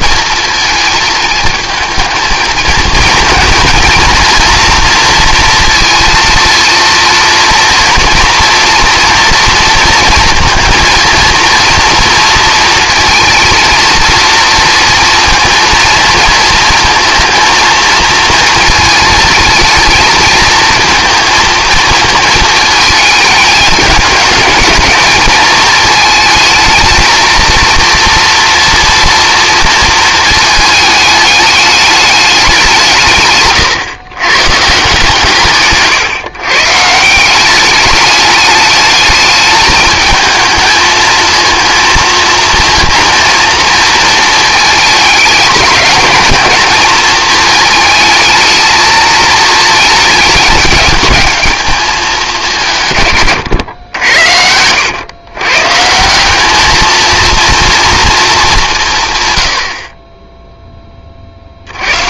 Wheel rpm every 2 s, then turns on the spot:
230, 230, 230, 240, 230, 230, 230, 230, 230, 230, 230, 220, 210, 220, 230, 220, 170, 150, 150, 210, 220, 230, 220, 220, 220, 210, 140, 100, 220, 180, 10.
none